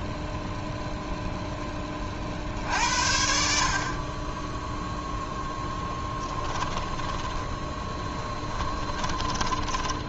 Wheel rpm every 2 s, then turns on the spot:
0, 60, 10, 10, 10.
6-10